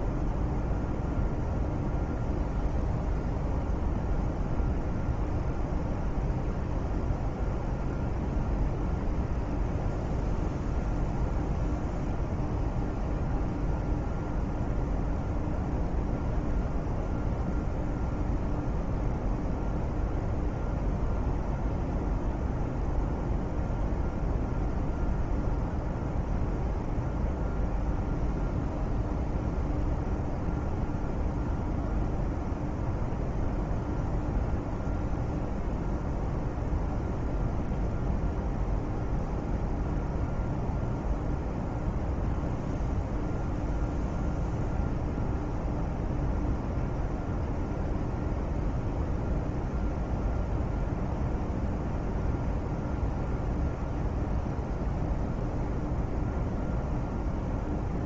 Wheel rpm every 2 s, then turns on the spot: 0, 0, 0, 0, 0, 0, 0, 0, 0, 0, 0, 0, 0, 0, 0, 0, 0, 0, 0, 0, 0, 0, 0, 0, 0, 0, 0, 0, 0.
none